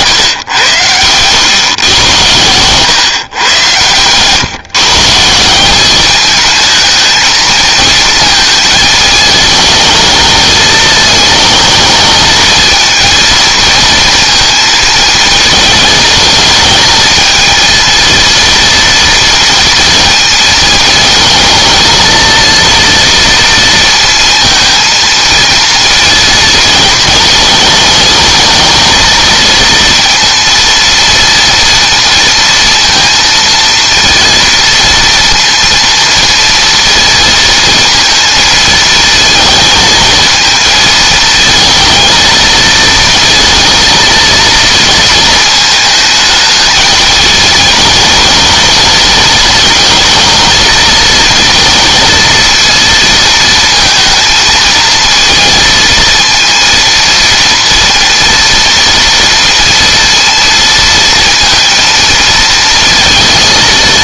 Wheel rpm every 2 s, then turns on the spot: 130, 110, 130, 220, 220, 220, 220, 230, 220, 230, 230, 230, 230, 230, 220, 230, 230, 230, 230, 230, 220, 230, 230, 220, 220, 220, 230, 220, 230, 230, 230, 230.
none